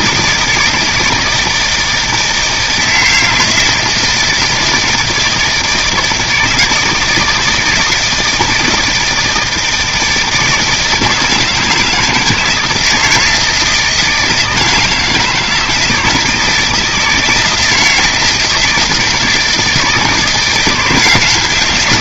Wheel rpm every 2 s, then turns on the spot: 160, 160, 160, 160, 160, 160, 160, 160, 160, 160, 170.
none